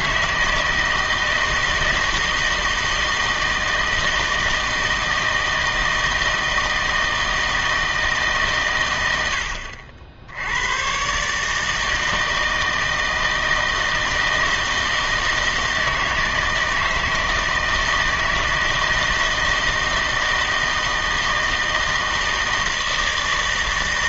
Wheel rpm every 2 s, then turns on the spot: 160, 160, 160, 160, 130, 90, 160, 160, 160, 160, 160, 160.
none